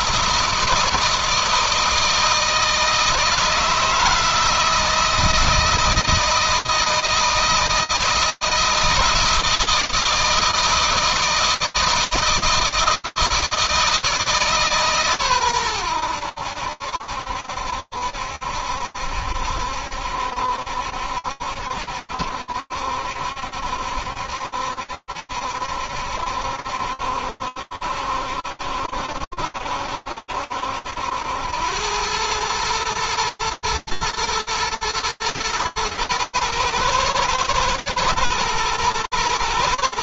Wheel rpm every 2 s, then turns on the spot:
170, 160, 160, 160, 160, 160, 160, 140, 70, 70, 70, 70, 70, 70, 70, 80, 110, 110, 110, 110.
none